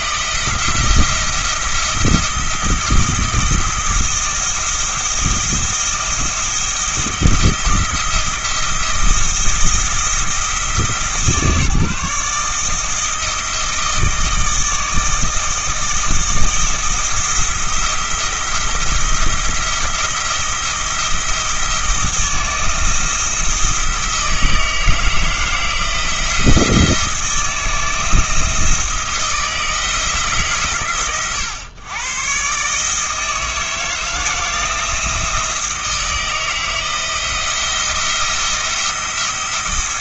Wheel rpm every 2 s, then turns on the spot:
170, 160, 160, 170, 170, 160, 160, 160, 160, 170, 170, 160, 160, 170, 170, 140, 140, 160, 160, 170.
none